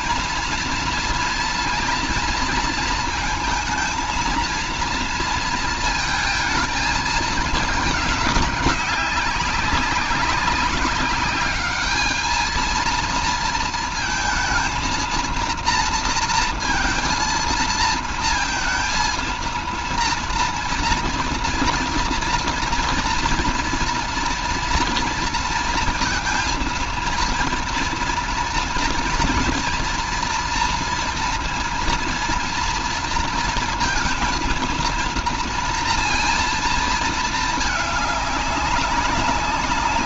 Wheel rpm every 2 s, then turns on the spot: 230, 230, 230, 220, 190, 200, 220, 230, 230, 230, 240, 240, 230, 230, 230, 230, 230, 230, 230, 200.
none